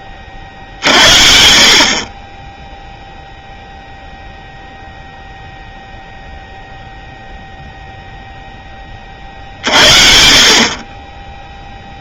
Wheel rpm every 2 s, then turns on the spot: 40, 30, 0, 0, 30, 20.
none